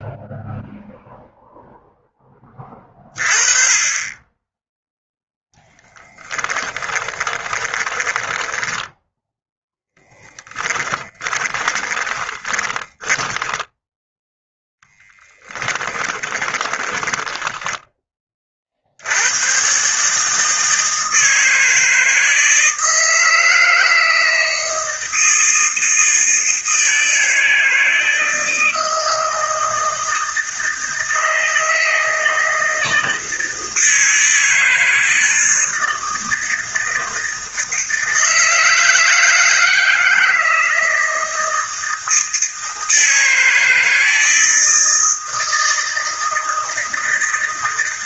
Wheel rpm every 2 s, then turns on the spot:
0, 30, 10, 20, 10, 20, 10, 0, 20, 70, 160, 160, 160, 160, 160, 160, 160, 160, 160, 160, 160, 160, 160, 160.
6-14 16-18